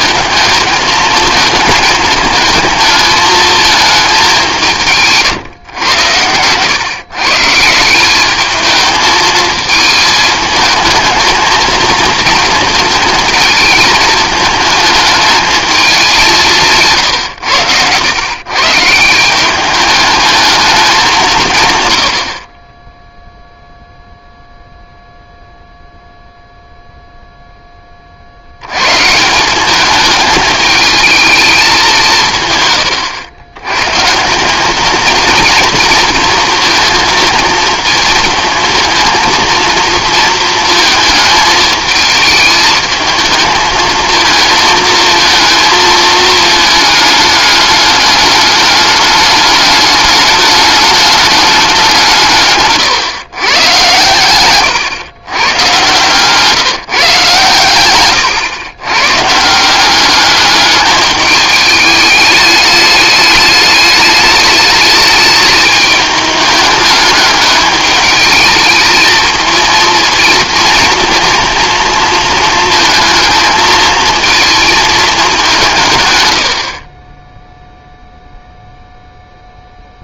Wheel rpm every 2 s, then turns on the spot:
220, 220, 140, 150, 220, 230, 220, 210, 100, 190, 150, 0, 0, 0, 150, 220, 100, 230, 230, 230, 220, 220, 230, 210, 210, 210, 130, 120, 140, 140, 210, 210, 220, 210, 220, 230, 220, 210, 10, 0.
none